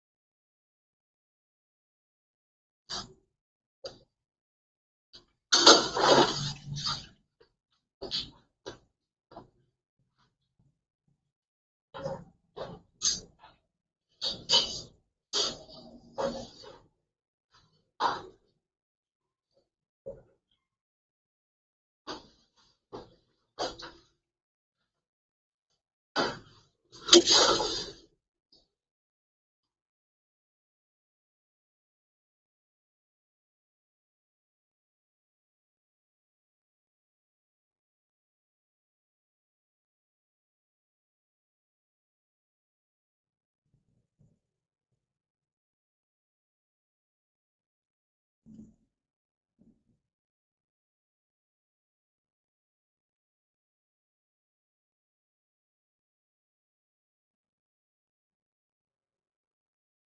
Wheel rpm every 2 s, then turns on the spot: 0, 0, 0, 0, 0, 0, 0, 0, 0, 0, 0, 0, 0, 0, 0, 0, 0, 0, 0, 0, 0, 0, 0, 0, 0, 0, 0, 0, 0, 0.
none